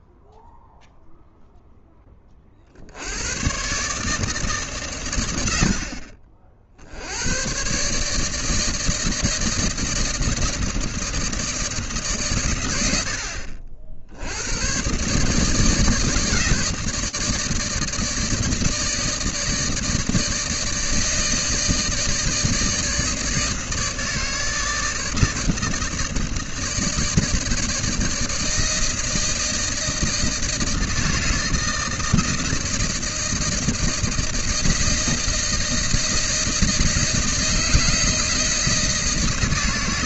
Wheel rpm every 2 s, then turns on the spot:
0, 60, 140, 60, 160, 160, 90, 130, 160, 160, 160, 160, 160, 160, 160, 160, 160, 160, 160, 150.
none